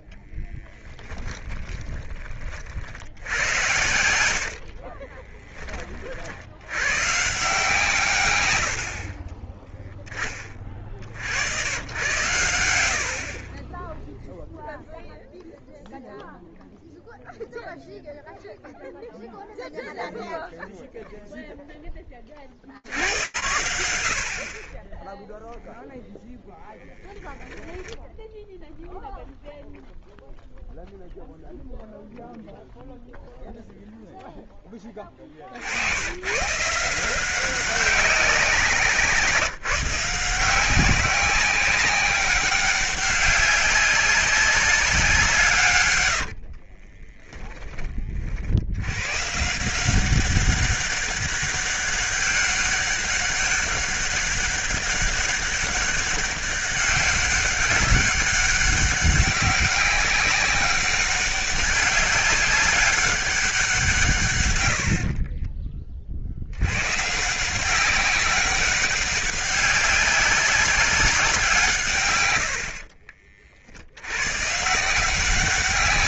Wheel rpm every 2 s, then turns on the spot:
20, 40, 80, 70, 80, 40, 110, 0, 0, 0, 0, 80, 30, 10, 0, 0, 0, 10, 140, 180, 170, 200, 200, 60, 70, 200, 200, 200, 190, 200, 200, 200, 120, 100, 200, 200, 80, 140.
0-2 4-6 46-48